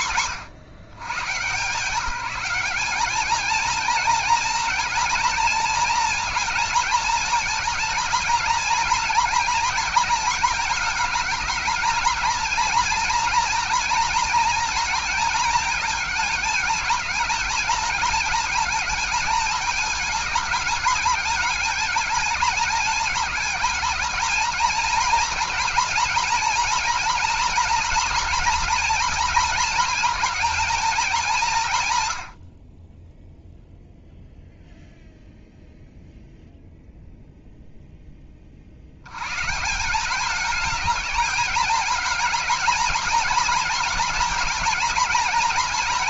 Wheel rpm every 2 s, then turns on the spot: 120, 220, 230, 220, 230, 220, 230, 230, 220, 220, 210, 220, 230, 230, 230, 210, 10, 0, 0, 110, 220, 230, 230.
32-34